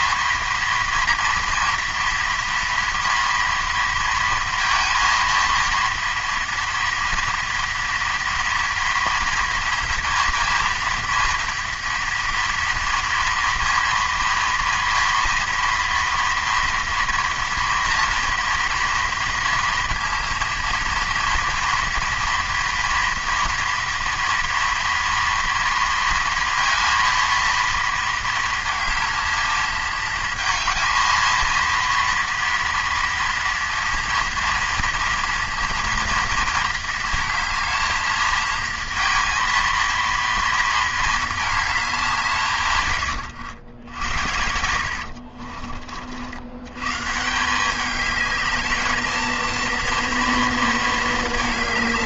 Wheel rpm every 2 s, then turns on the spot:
230, 230, 230, 230, 230, 230, 230, 230, 230, 230, 230, 230, 230, 230, 230, 220, 230, 240, 230, 220, 220, 130, 70, 90, 210, 230.
44-46